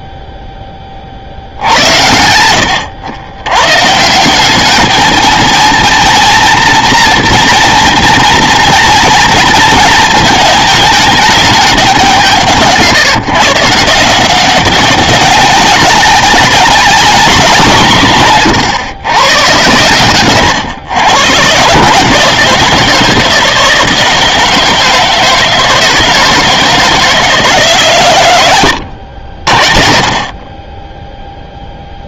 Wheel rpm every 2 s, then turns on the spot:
10, 90, 200, 230, 230, 220, 160, 190, 200, 120, 120, 160, 160, 160, 90, 20.
none